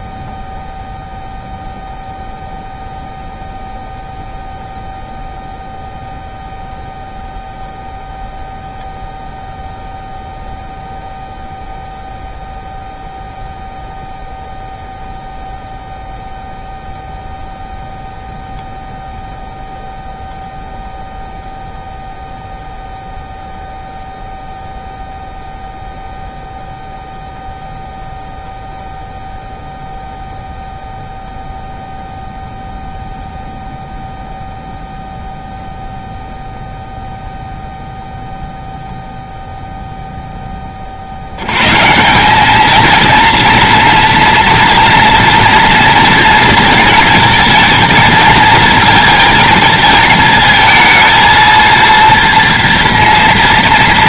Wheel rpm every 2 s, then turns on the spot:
0, 0, 0, 0, 0, 0, 0, 0, 0, 0, 0, 0, 0, 0, 0, 0, 0, 0, 0, 0, 50, 220, 230, 220, 220, 230, 230.
none